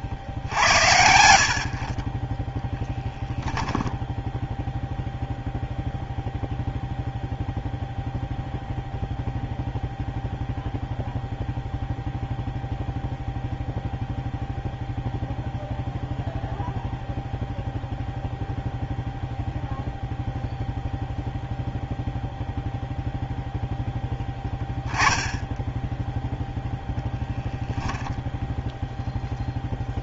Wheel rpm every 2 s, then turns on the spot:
70, 10, 0, 0, 0, 0, 0, 0, 0, 0, 0, 0, 0, 0, 0.
none